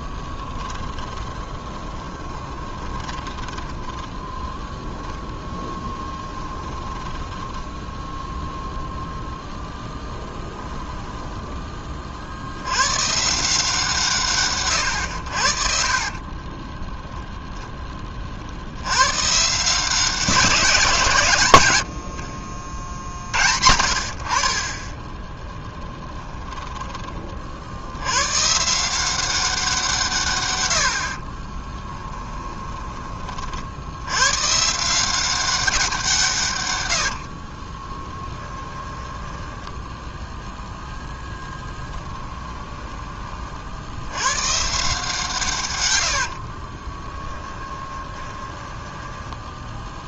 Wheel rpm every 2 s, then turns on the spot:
10, 20, 0, 10, 0, 10, 100, 110, 20, 70, 170, 50, 20, 20, 160, 80, 20, 150, 110, 10, 10, 10, 130, 30, 10.
0-4 6-8 10-12 16-18 32-34 38-40 42-44 46-50